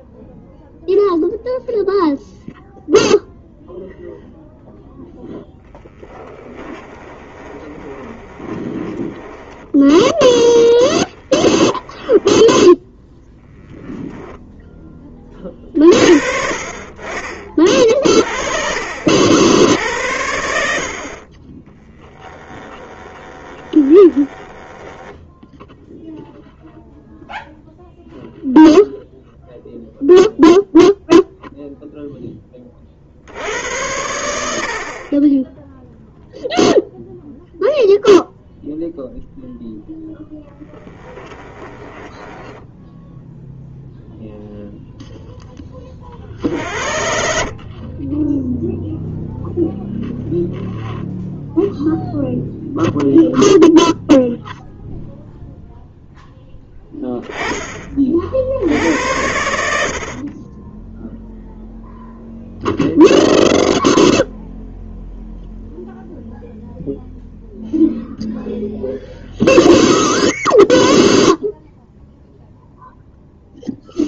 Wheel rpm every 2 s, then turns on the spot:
0, 0, 0, 20, 20, 10, 10, 20, 30, 50, 60, 20, 10, 0, 0, 0, 20, 70, 0, 0, 10, 10, 0, 70, 0, 0, 0, 0, 10, 70, 20, 0, 0, 0, 0, 0, 0.
6-12 22-26 40-44